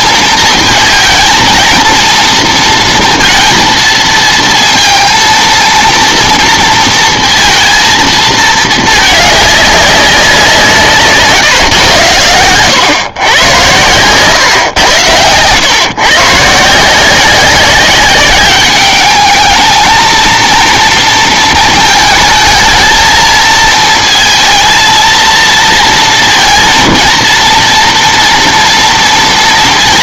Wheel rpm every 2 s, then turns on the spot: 220, 230, 230, 230, 220, 170, 100, 130, 150, 210, 230, 220, 230, 230, 230.
12-14